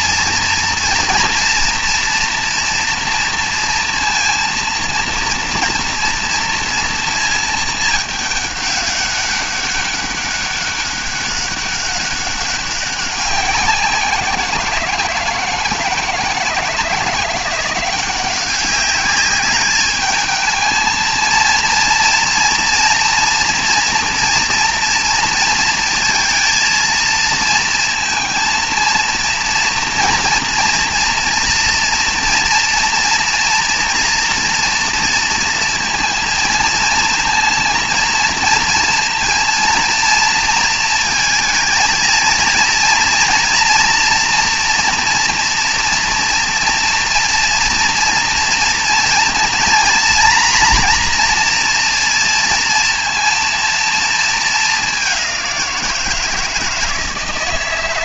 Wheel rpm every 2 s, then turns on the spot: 230, 240, 230, 230, 200, 200, 200, 170, 170, 190, 220, 230, 230, 230, 230, 230, 240, 230, 230, 230, 230, 230, 240, 240, 230, 240, 230, 210, 160.
none